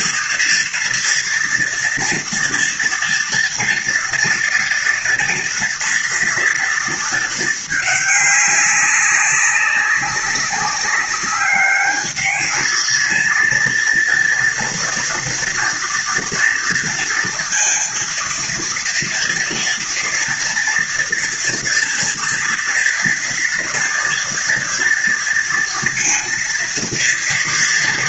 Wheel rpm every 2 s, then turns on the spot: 230, 230, 230, 240, 200, 200, 220, 230, 240, 230, 230, 230, 230, 230.
none